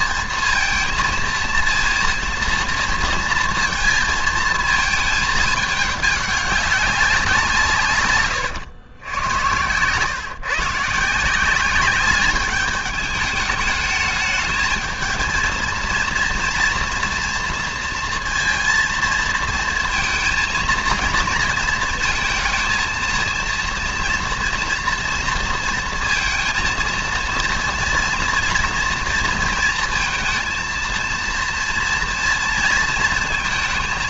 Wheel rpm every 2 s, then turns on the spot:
220, 230, 220, 200, 120, 150, 210, 210, 230, 230, 230, 230, 230, 230, 240, 230, 230.
none